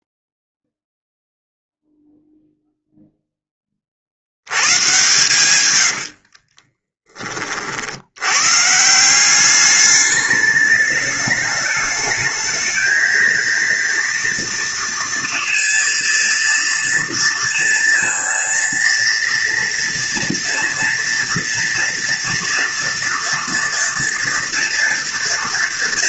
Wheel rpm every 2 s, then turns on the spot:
0, 0, 100, 40, 130, 210, 220, 230, 230, 230, 230, 230, 230.
6-8